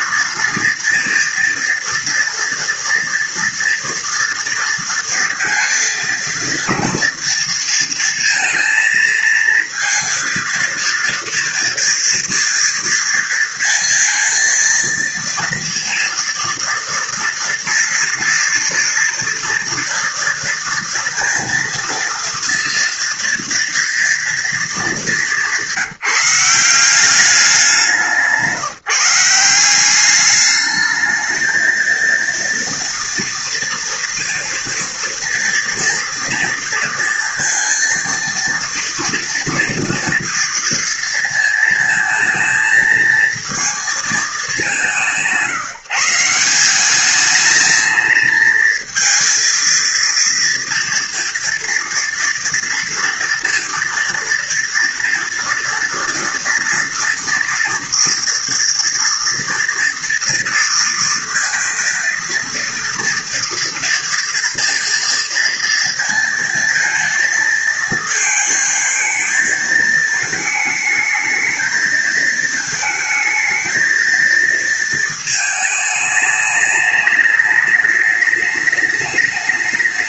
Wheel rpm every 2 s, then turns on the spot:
230, 240, 230, 230, 230, 230, 230, 230, 240, 230, 230, 230, 210, 190, 160, 220, 230, 230, 230, 240, 230, 230, 160, 210, 230, 230, 230, 230, 230, 230, 230, 230, 230, 230, 220, 220, 220, 220, 210, 210.
none